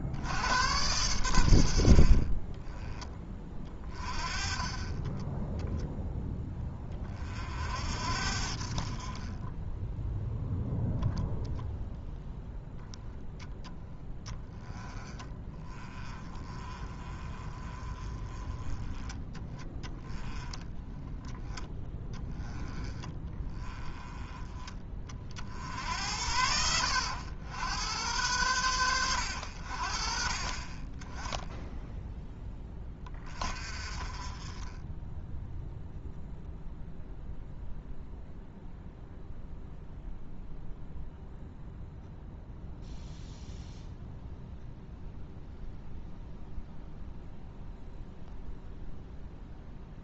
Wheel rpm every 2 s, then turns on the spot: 90, 20, 20, 20, 50, 10, 10, 10, 30, 20, 10, 10, 20, 70, 120, 30, 10, 20, 0, 0, 0, 0, 0, 0, 0.
16-24